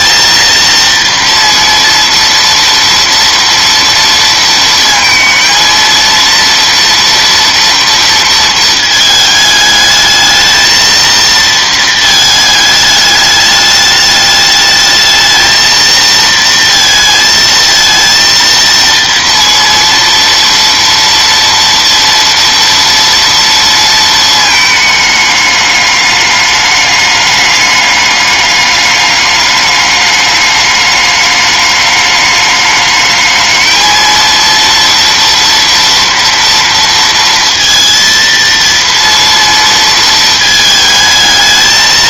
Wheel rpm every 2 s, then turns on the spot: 230, 230, 230, 230, 230, 220, 220, 210, 230, 230, 230, 230, 220, 210, 200, 210, 210, 230, 230, 230, 220.
none